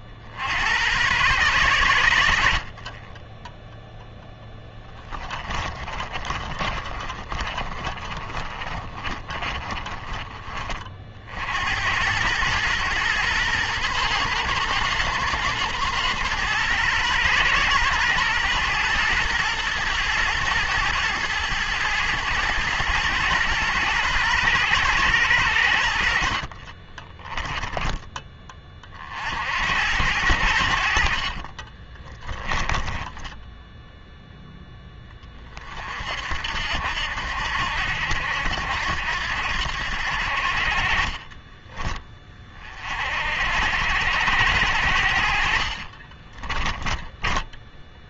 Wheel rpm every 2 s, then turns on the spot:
80, 50, 10, 30, 30, 30, 110, 110, 110, 110, 110, 110, 110, 40, 30, 80, 20, 0, 70, 80, 50, 30, 80, 20.
4-10 26-28 32-34 46-48